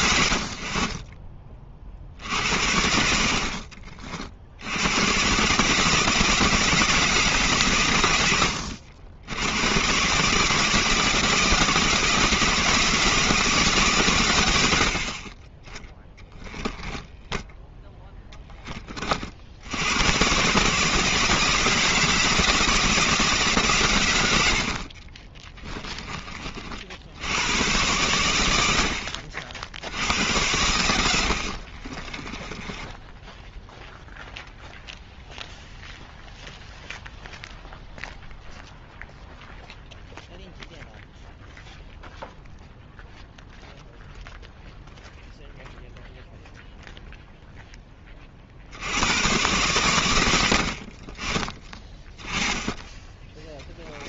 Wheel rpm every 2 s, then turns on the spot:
70, 80, 90, 160, 90, 160, 160, 80, 10, 30, 150, 160, 50, 60, 70, 90, 10, 0, 0, 0, 0, 0, 0, 0, 50, 40, 20.
24-26 32-34 52-54